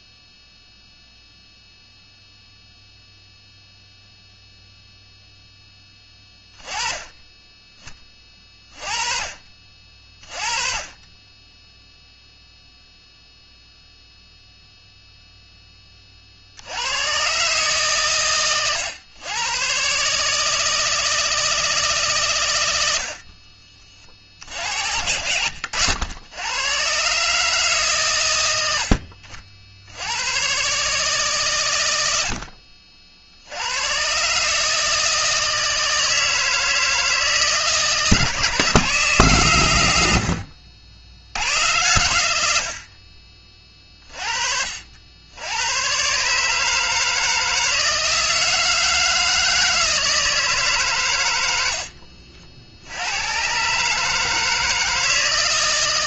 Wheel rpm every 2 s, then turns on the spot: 0, 0, 0, 20, 30, 20, 0, 0, 100, 120, 160, 70, 60, 130, 70, 140, 60, 160, 160, 160, 90, 50, 70, 160, 160, 130, 90, 160.
22-24